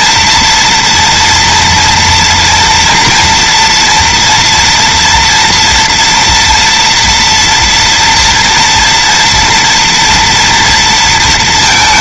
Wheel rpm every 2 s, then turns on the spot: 240, 230, 230, 230, 240, 230.
none